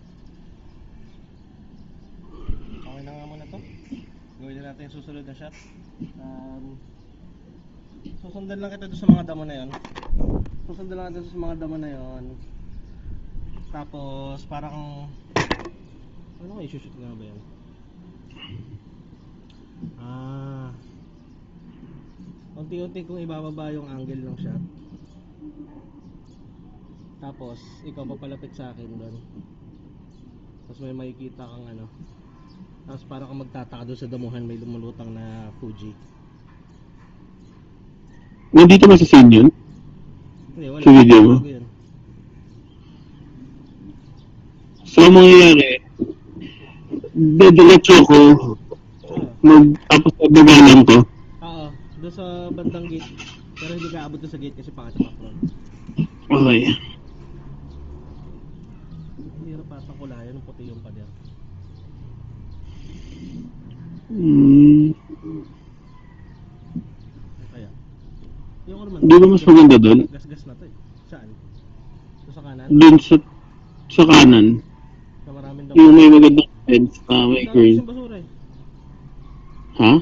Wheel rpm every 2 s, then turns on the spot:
0, 0, 0, 0, 0, 0, 0, 0, 0, 0, 0, 0, 0, 0, 0, 0, 0, 0, 0, 0, 0, 0, 0, 0, 0, 0, 0, 0, 0, 0, 0, 0, 0, 0, 0, 0, 0, 0, 0, 0.
none